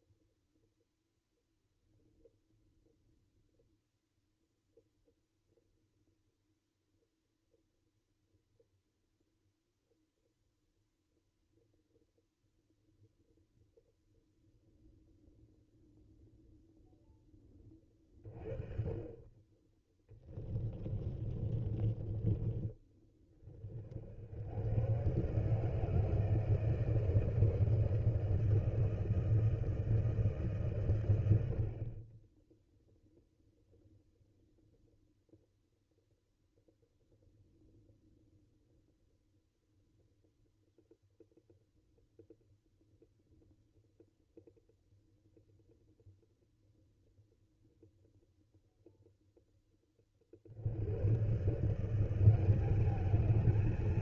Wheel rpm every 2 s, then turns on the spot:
0, 0, 0, 0, 0, 0, 0, 0, 0, 30, 20, 20, 110, 160, 160, 130, 0, 0, 0, 0, 0, 0, 0, 0, 0, 90, 200.
20-22